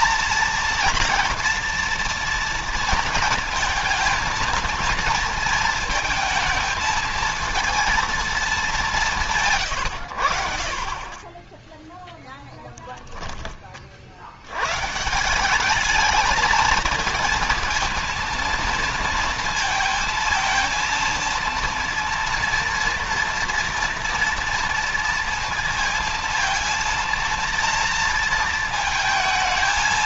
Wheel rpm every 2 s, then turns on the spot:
230, 230, 230, 220, 210, 50, 10, 100, 220, 230, 230, 230, 230, 230, 230.
none